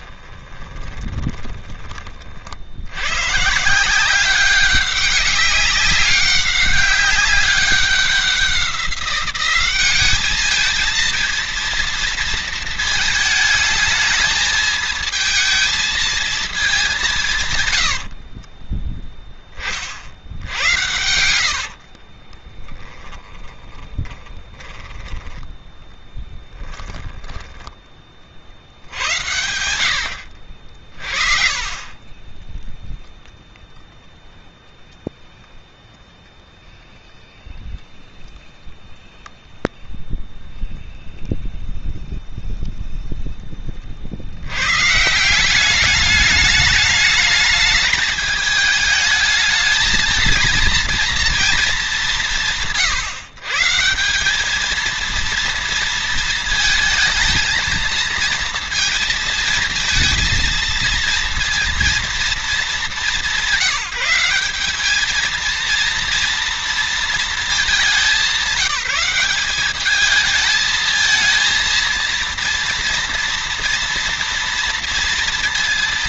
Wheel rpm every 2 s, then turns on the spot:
30, 90, 200, 200, 190, 220, 220, 220, 180, 0, 70, 10, 10, 10, 70, 50, 0, 0, 0, 0, 0, 0, 130, 210, 210, 230, 160, 220, 220, 230, 230, 190, 210, 230, 190, 220, 230, 230.
0-2 20-24 26-28